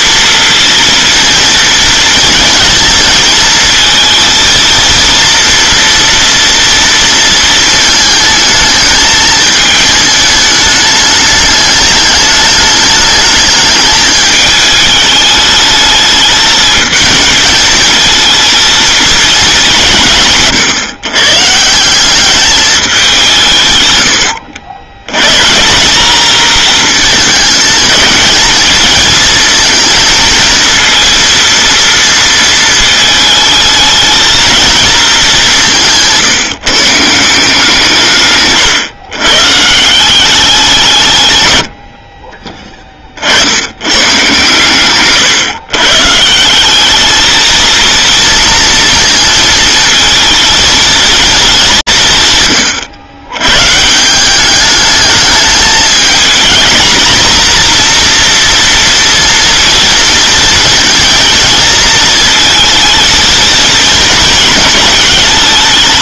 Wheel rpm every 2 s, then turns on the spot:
230, 230, 230, 230, 220, 210, 210, 210, 220, 230, 130, 210, 90, 220, 210, 230, 220, 230, 150, 130, 180, 20, 130, 190, 230, 220, 110, 200, 230, 240, 230, 220, 220.
none